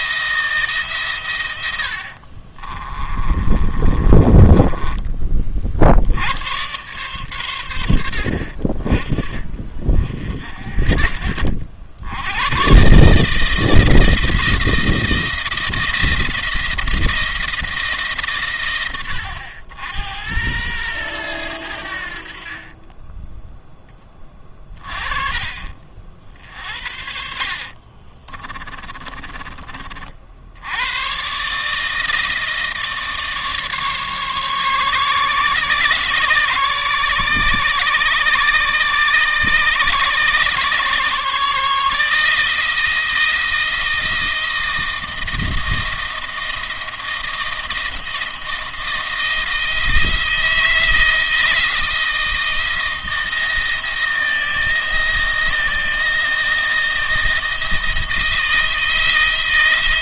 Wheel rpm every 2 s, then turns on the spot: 140, 30, 30, 110, 40, 40, 120, 160, 170, 110, 100, 20, 30, 60, 20, 100, 160, 140, 140, 140, 140, 160, 160, 170, 170, 160, 160, 170, 160, 160.
2-6 26-30